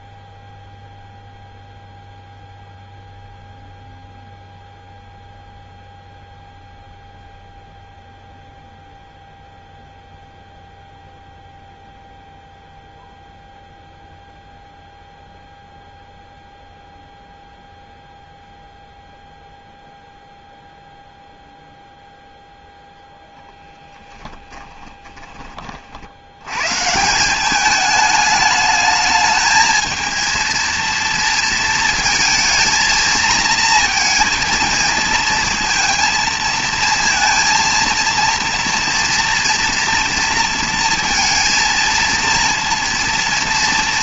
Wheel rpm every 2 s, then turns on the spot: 0, 0, 0, 0, 0, 0, 0, 0, 0, 0, 0, 0, 10, 120, 210, 230, 230, 230, 230, 230, 230, 230.
24-26